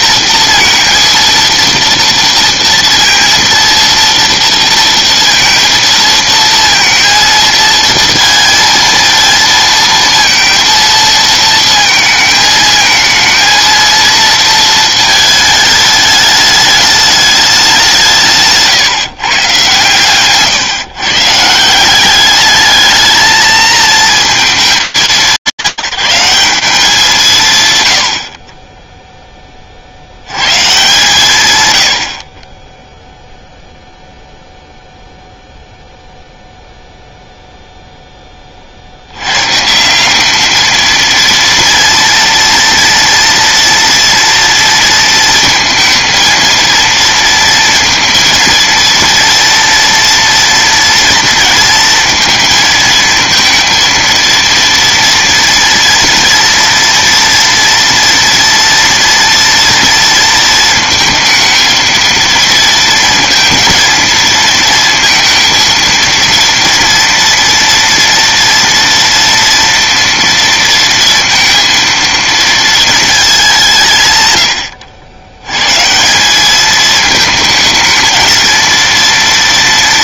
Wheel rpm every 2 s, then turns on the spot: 230, 230, 230, 230, 220, 230, 220, 230, 210, 150, 130, 210, 190, 180, 50, 130, 20, 0, 0, 90, 230, 230, 230, 230, 230, 230, 220, 230, 230, 230, 220, 230, 230, 230, 230, 230, 220, 80, 220, 230.
none